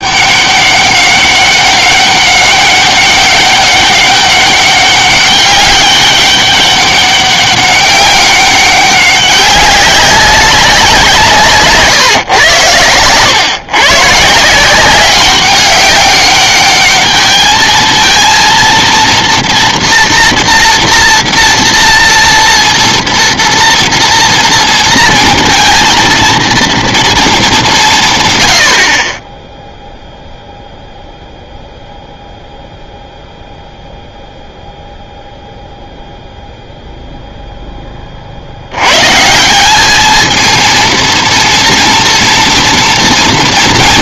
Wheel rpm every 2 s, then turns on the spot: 200, 200, 200, 200, 190, 190, 120, 170, 210, 230, 240, 230, 230, 230, 90, 0, 0, 0, 0, 80, 230, 230.
none